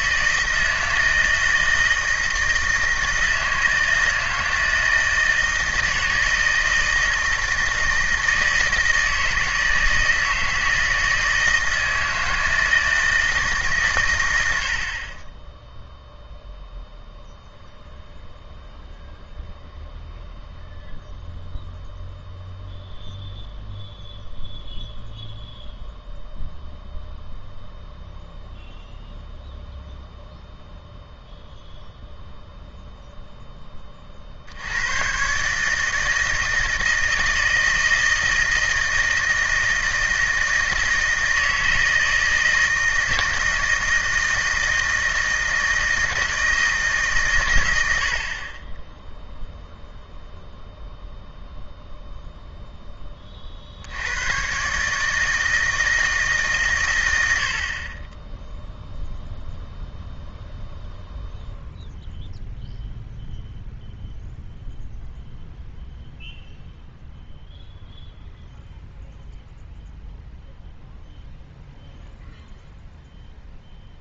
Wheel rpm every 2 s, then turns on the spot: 160, 160, 160, 160, 160, 160, 160, 60, 0, 0, 0, 0, 0, 0, 0, 0, 0, 80, 160, 160, 160, 160, 160, 160, 20, 0, 0, 130, 130, 0, 0, 0, 0, 0, 0, 0, 0.
none